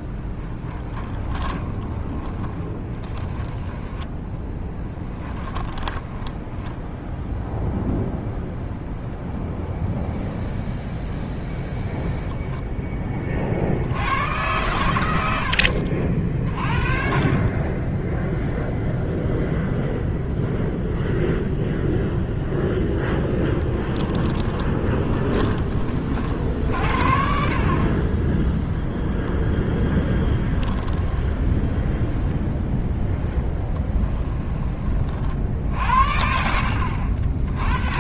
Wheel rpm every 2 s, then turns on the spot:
20, 20, 10, 10, 0, 0, 20, 100, 40, 0, 0, 10, 20, 60, 10, 20, 10, 30, 80.
0-8 22-26 30-34